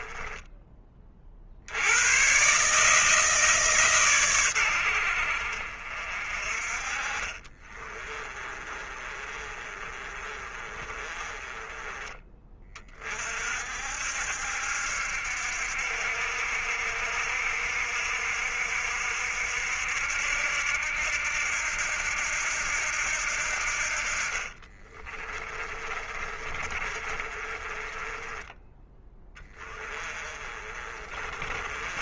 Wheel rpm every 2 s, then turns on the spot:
30, 150, 100, 40, 30, 30, 30, 70, 60, 60, 70, 70, 40, 30, 10, 30.
8-12 24-28 30-32